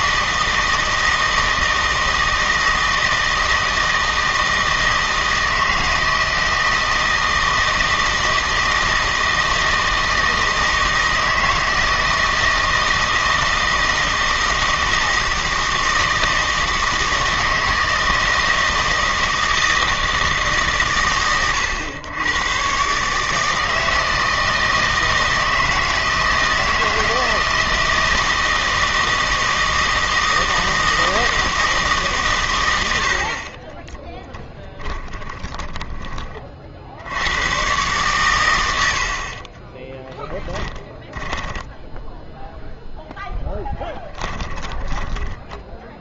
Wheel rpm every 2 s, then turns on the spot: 160, 160, 160, 160, 160, 160, 160, 160, 160, 160, 140, 130, 160, 160, 160, 160, 90, 10, 50, 80, 20, 10, 20.
34-36 40-42 44-46